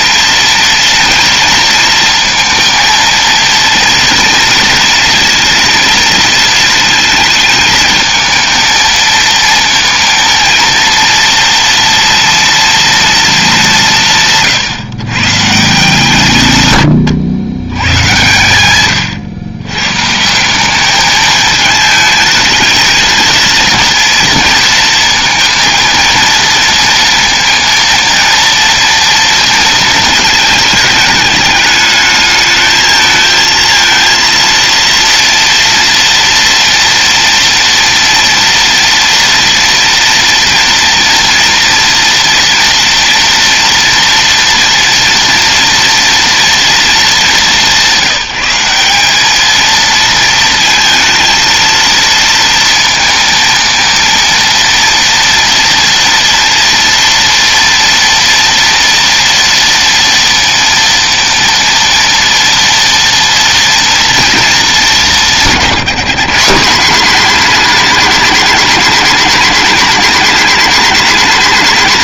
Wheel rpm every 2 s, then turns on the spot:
230, 230, 230, 220, 230, 230, 230, 140, 110, 110, 210, 220, 230, 230, 230, 220, 220, 230, 230, 230, 230, 230, 230, 210, 200, 230, 230, 230, 230, 230, 230, 230, 200, 200, 220, 190.
none